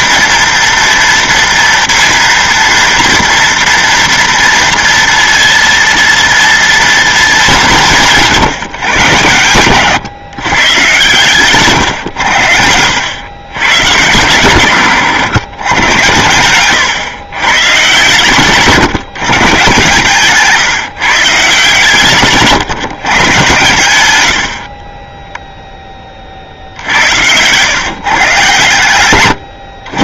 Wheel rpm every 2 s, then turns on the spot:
230, 230, 230, 230, 160, 130, 80, 130, 120, 150, 150, 150, 70, 60, 130.
18-20 24-26